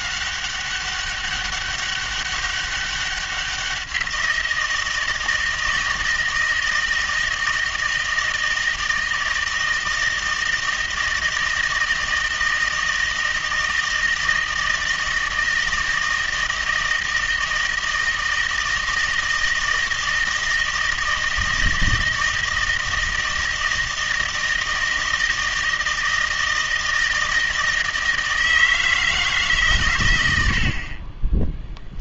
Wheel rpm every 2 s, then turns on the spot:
200, 200, 170, 160, 160, 160, 160, 160, 160, 160, 160, 160, 160, 160, 160, 50.
none